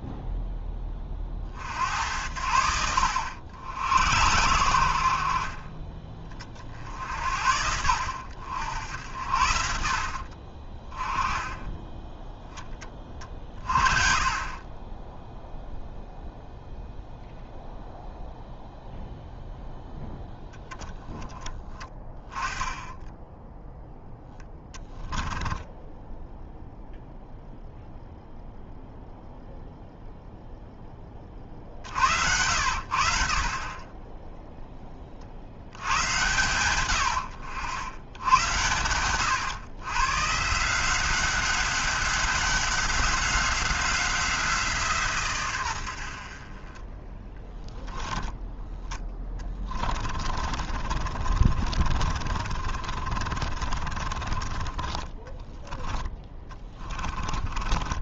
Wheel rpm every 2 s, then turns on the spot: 10, 80, 90, 50, 80, 40, 10, 20, 0, 0, 0, 20, 10, 0, 0, 0, 80, 10, 110, 100, 150, 190, 170, 30, 10, 40, 40, 20, 20.
10-12 24-26 48-58